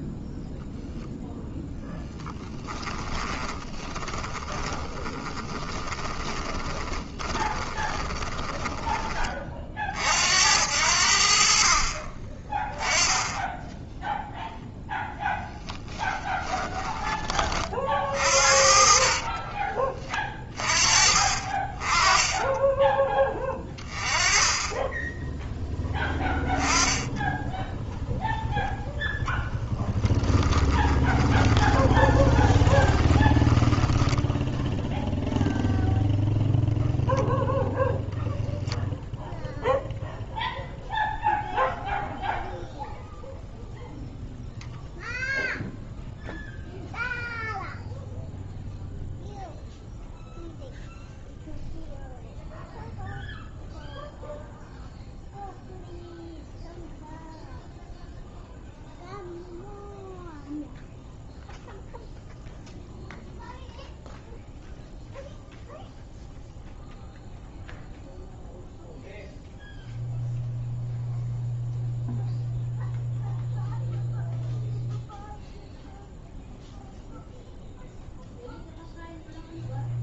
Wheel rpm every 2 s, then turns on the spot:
0, 30, 20, 20, 20, 70, 10, 10, 20, 40, 40, 20, 20, 10, 0, 20, 20, 0, 0, 0, 0, 0, 0, 0, 0, 0, 0, 0, 0, 0, 0, 0, 0, 0, 0, 0, 0, 0, 0, 0.
2-8 20-22 30-34